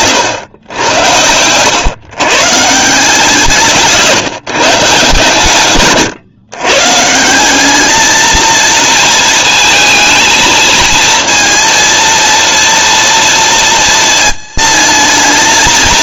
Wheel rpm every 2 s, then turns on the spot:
100, 160, 150, 140, 230, 220, 230, 220.
none